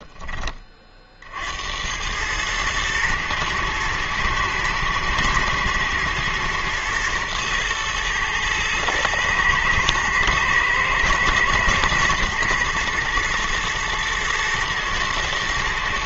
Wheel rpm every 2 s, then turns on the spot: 40, 110, 110, 120, 110, 110, 120, 120.
none